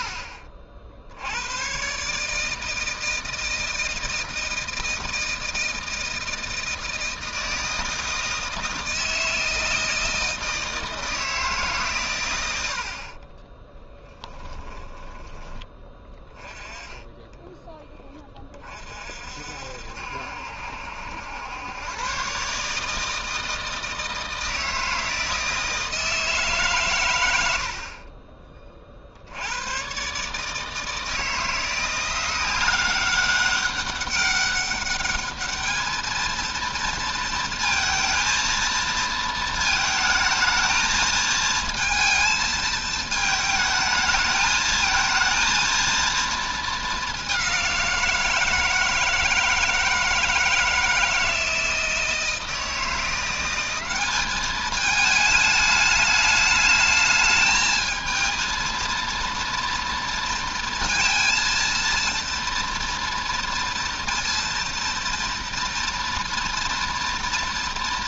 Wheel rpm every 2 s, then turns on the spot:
60, 160, 160, 160, 160, 160, 60, 10, 10, 40, 70, 150, 160, 140, 40, 160, 190, 200, 230, 230, 220, 220, 220, 210, 160, 160, 170, 210, 220, 220, 230, 230, 230, 230.
none